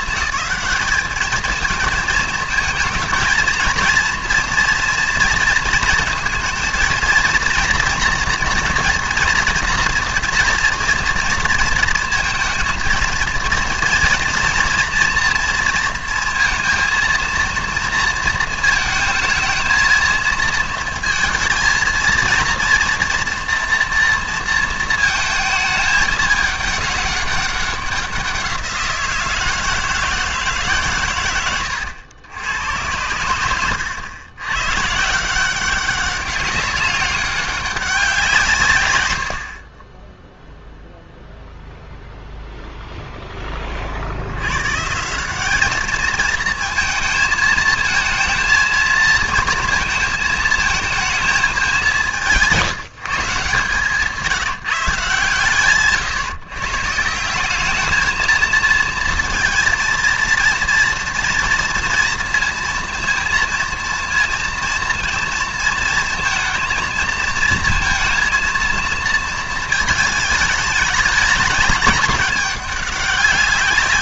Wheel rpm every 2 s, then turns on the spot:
220, 220, 240, 230, 230, 240, 230, 230, 230, 220, 230, 230, 230, 210, 180, 150, 100, 120, 190, 160, 0, 0, 110, 220, 230, 230, 180, 150, 140, 230, 230, 230, 230, 230, 230, 210, 200.
none